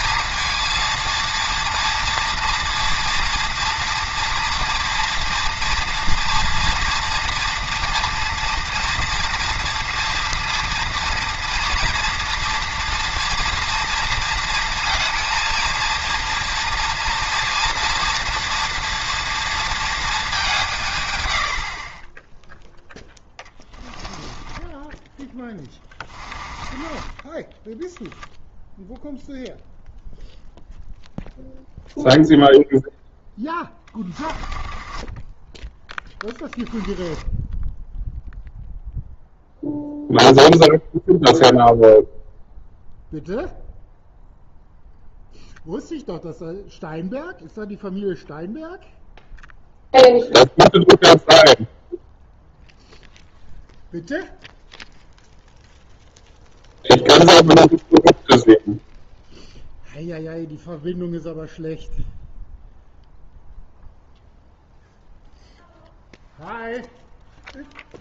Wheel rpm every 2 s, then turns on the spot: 230, 230, 240, 230, 230, 230, 240, 230, 230, 240, 150, 0, 10, 20, 0, 0, 0, 20, 10, 0, 0, 0, 0, 0, 0, 0, 0, 0, 0, 0, 0, 0, 0, 0.
24-28 34-38